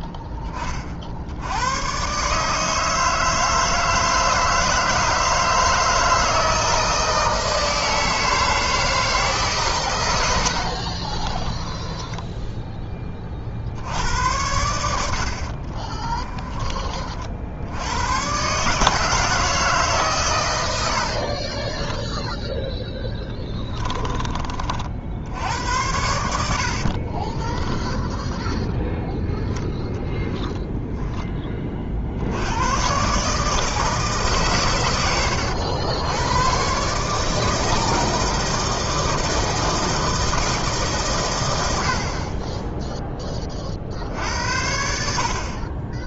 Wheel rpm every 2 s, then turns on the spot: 20, 150, 160, 160, 160, 60, 20, 90, 30, 150, 90, 10, 50, 60, 0, 10, 100, 130, 130, 160, 150, 10, 70.
10-12 26-28